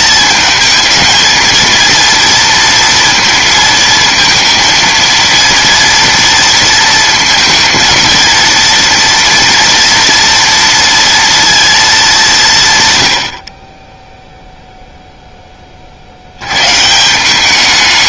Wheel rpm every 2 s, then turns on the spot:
220, 230, 230, 230, 230, 230, 150, 0, 110.
none